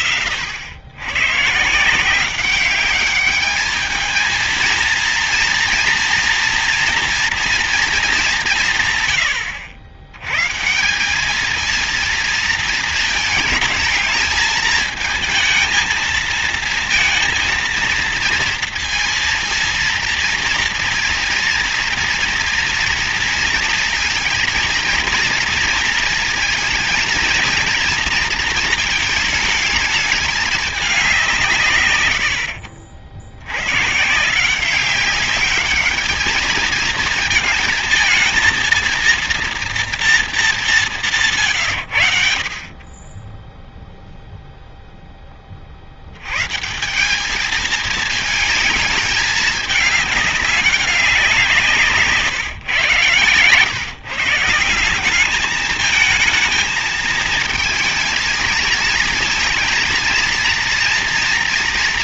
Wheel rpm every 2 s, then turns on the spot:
80, 190, 220, 230, 190, 130, 230, 220, 220, 230, 230, 230, 230, 230, 230, 210, 90, 160, 220, 230, 220, 60, 0, 130, 220, 200, 150, 150, 220, 220, 230.
none